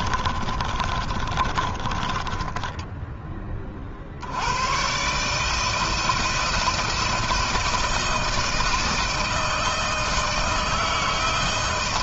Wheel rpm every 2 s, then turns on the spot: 30, 20, 130, 160, 160, 160.
0-4